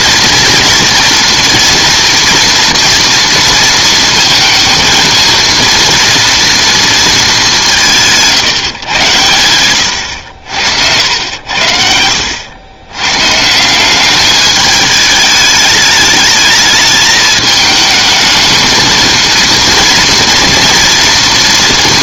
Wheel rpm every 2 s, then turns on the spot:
230, 230, 230, 230, 110, 80, 100, 210, 220, 220, 230.
none